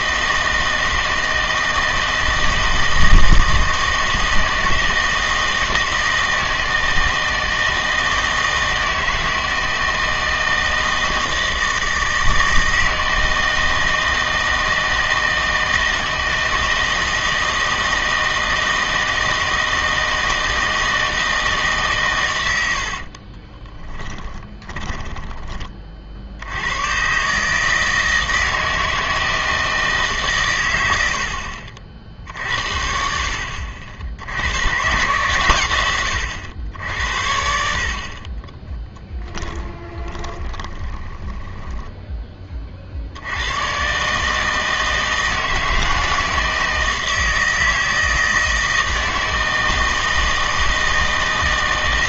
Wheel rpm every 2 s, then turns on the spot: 160, 160, 160, 160, 160, 160, 160, 160, 160, 160, 160, 90, 10, 90, 160, 100, 60, 110, 80, 20, 20, 40, 160, 160, 160, 160.
24-26 38-42